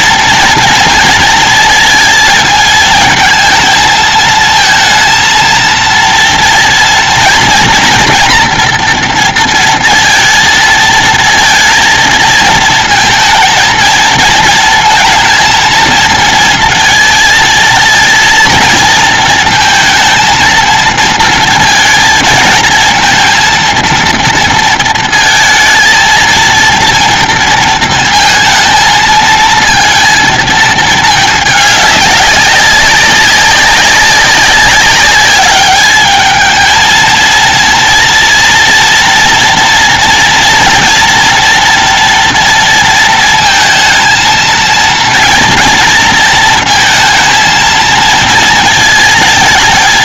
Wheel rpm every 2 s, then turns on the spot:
230, 220, 230, 230, 230, 230, 230, 230, 230, 230, 230, 220, 230, 230, 230, 220, 200, 200, 230, 230, 240, 230, 230, 220, 220.
none